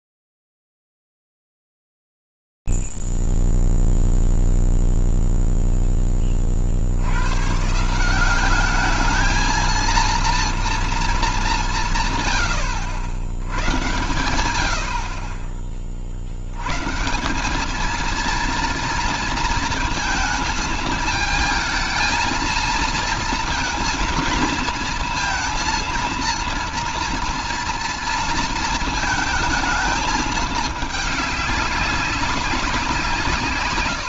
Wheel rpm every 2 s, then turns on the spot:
0, 0, 0, 0, 120, 220, 180, 100, 40, 200, 230, 220, 230, 230, 230, 220, 200.
none